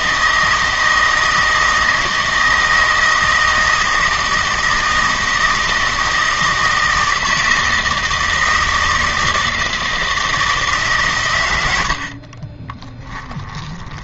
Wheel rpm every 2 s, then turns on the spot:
160, 160, 160, 160, 160, 140, 20.
12-14